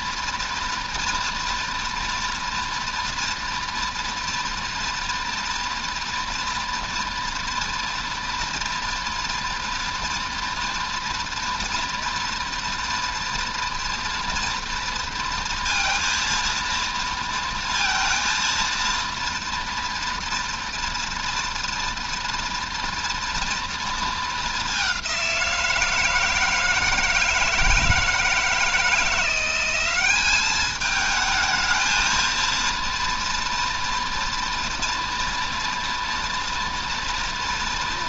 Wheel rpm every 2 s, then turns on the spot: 230, 230, 230, 230, 230, 230, 230, 230, 230, 240, 230, 230, 200, 160, 160, 210, 230, 230, 230.
none